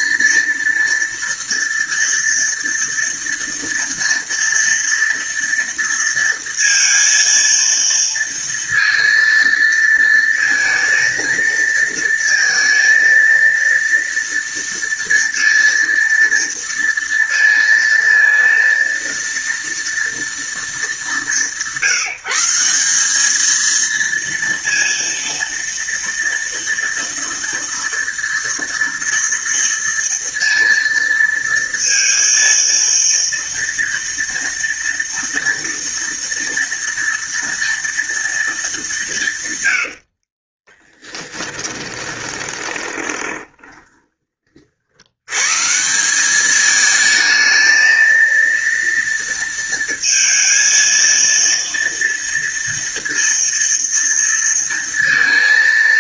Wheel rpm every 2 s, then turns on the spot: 230, 230, 230, 230, 230, 230, 230, 230, 230, 230, 200, 200, 230, 230, 230, 230, 230, 230, 230, 190, 10, 20, 90, 220, 230, 230, 230, 230.
40-44